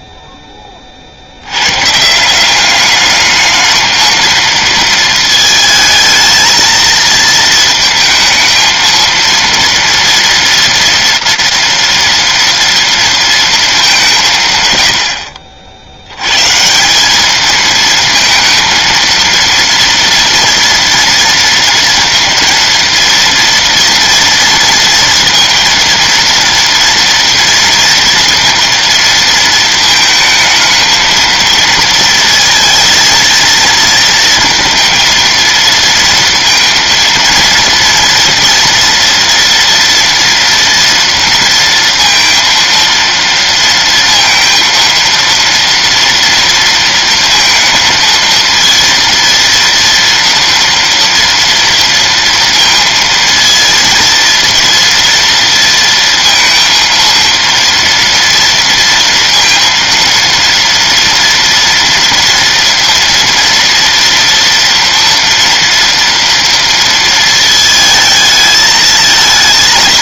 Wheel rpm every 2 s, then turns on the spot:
10, 190, 220, 220, 220, 230, 230, 150, 140, 230, 240, 230, 230, 230, 230, 220, 230, 230, 230, 230, 230, 230, 230, 230, 230, 230, 230, 230, 230, 230, 230, 230, 230, 230, 220.
none